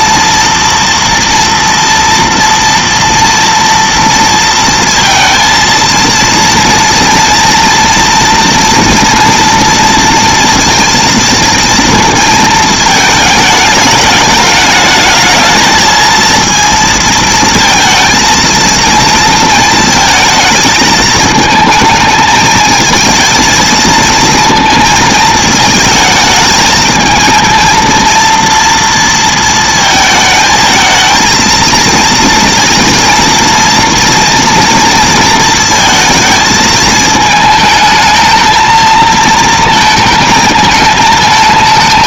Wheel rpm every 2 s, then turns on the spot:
230, 230, 230, 230, 230, 230, 220, 210, 230, 230, 220, 220, 230, 220, 230, 220, 230, 230, 220, 220, 220.
none